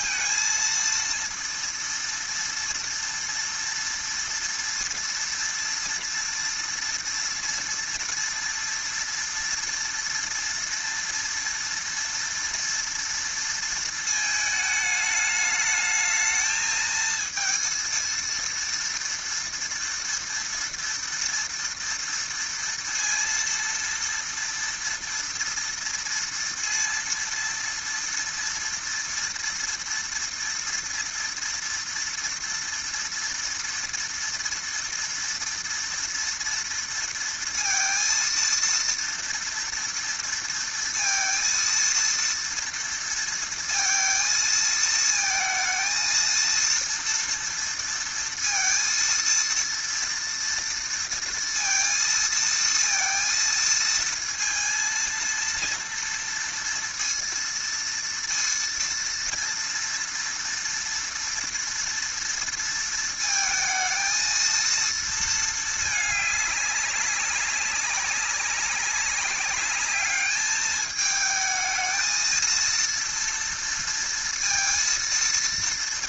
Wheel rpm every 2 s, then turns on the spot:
230, 230, 230, 240, 230, 230, 230, 210, 220, 230, 230, 230, 230, 230, 230, 230, 230, 230, 230, 230, 230, 230, 220, 230, 230, 230, 230, 230, 230, 230, 230, 230, 230, 200, 200, 220, 230, 230.
none